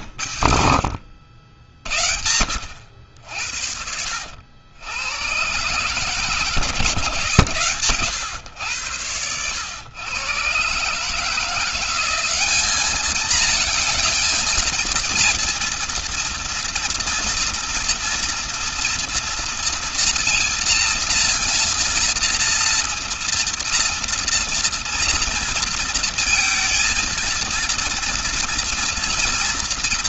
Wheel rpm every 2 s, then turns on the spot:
70, 80, 90, 150, 120, 130, 200, 220, 230, 230, 240, 230, 230, 230, 230.
none